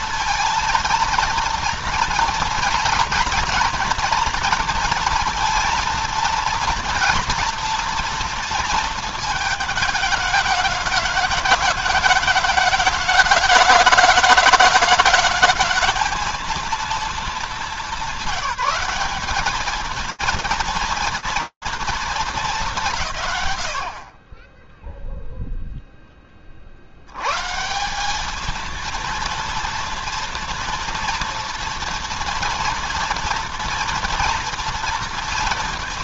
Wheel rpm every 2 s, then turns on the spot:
230, 230, 230, 230, 230, 220, 210, 210, 230, 200, 230, 110, 0, 90, 230, 240, 240, 230.
none